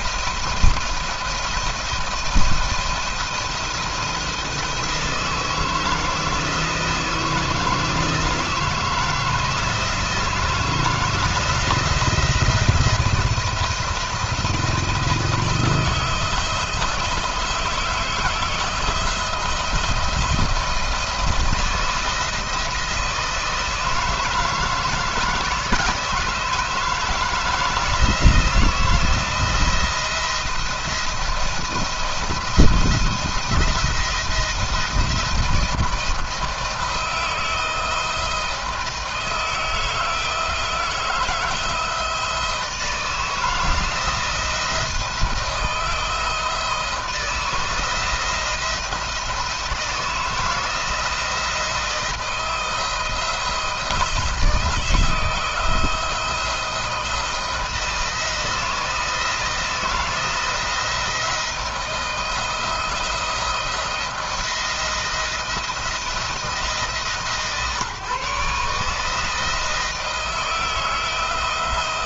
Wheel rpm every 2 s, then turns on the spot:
170, 170, 160, 160, 170, 160, 170, 160, 170, 170, 170, 160, 160, 160, 170, 170, 170, 170, 160, 160, 160, 160, 170, 160, 170, 160, 160, 170, 170, 160, 170, 170, 170, 150, 150, 160.
none